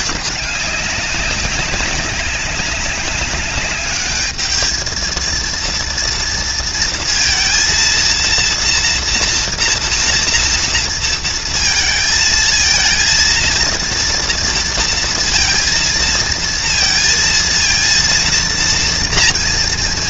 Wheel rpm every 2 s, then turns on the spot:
200, 200, 220, 230, 230, 230, 230, 230, 230, 230.
none